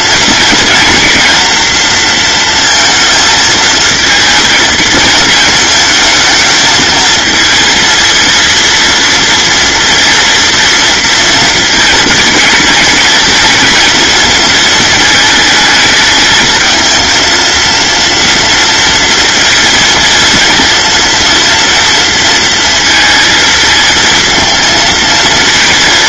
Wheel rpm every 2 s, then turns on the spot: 230, 230, 220, 220, 230, 230, 220, 220, 230, 230, 230, 230, 220.
none